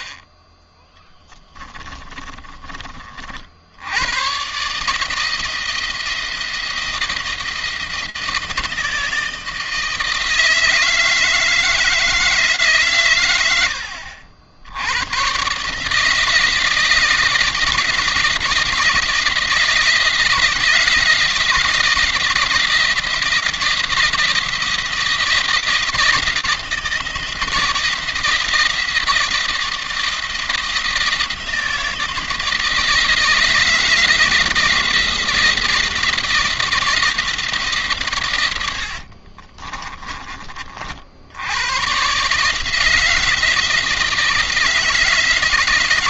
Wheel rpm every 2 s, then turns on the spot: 20, 40, 150, 170, 160, 160, 130, 90, 170, 160, 160, 170, 170, 160, 170, 170, 160, 160, 170, 80, 50, 160, 160.
0-2 38-40